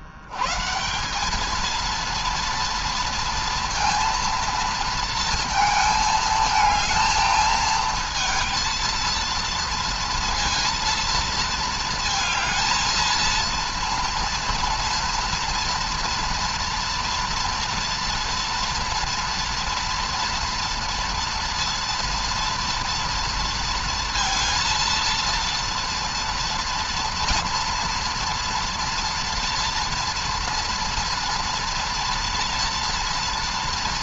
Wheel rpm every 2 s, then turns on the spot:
140, 230, 230, 220, 230, 230, 220, 230, 230, 230, 230, 230, 230, 230, 230, 230, 230.
none